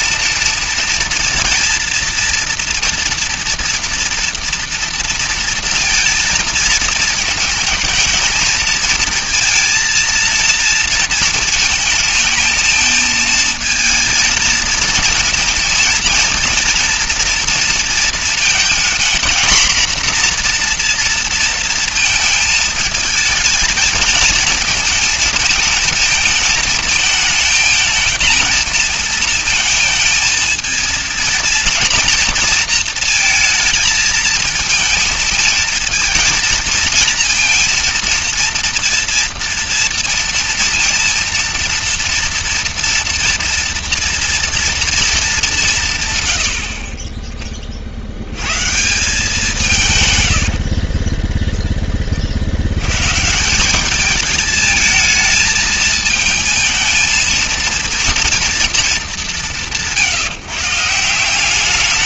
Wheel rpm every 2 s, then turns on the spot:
230, 230, 230, 220, 220, 230, 220, 230, 230, 230, 240, 220, 230, 220, 230, 230, 230, 230, 230, 230, 230, 230, 230, 90, 130, 60, 70, 220, 220, 230, 150.
50-52